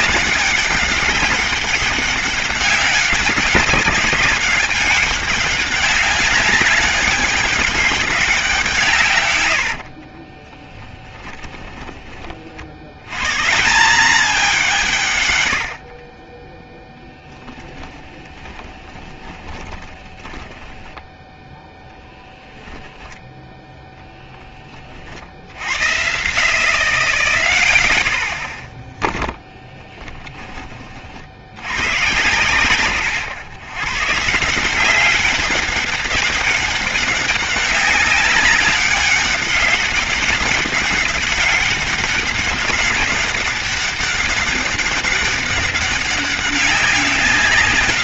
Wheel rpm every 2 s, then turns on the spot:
200, 200, 200, 190, 180, 20, 50, 200, 20, 20, 10, 10, 10, 70, 0, 20, 120, 160, 200, 200, 200, 190, 200, 190.
10-12 16-22